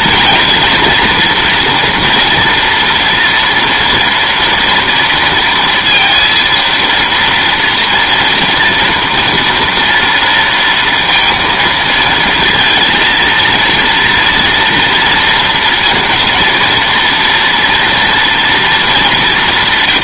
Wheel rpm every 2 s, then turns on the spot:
230, 230, 230, 230, 240, 230, 230, 230, 230, 220.
none